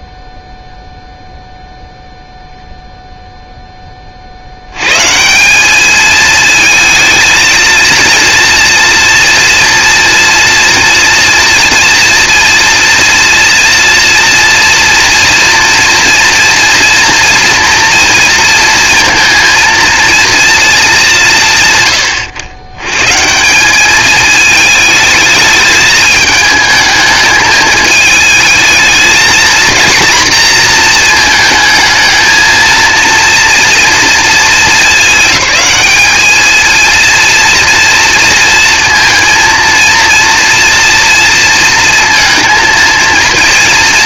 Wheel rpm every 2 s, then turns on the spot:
0, 0, 70, 220, 230, 230, 230, 230, 230, 230, 230, 120, 220, 220, 220, 240, 230, 230, 220, 230, 230, 230.
none